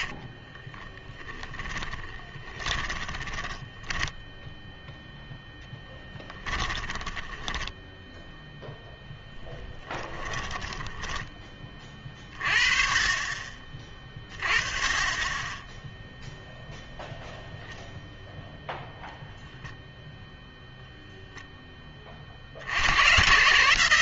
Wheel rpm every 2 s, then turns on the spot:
20, 20, 0, 10, 10, 20, 30, 20, 0, 0, 0, 70.
0-4 6-8 10-12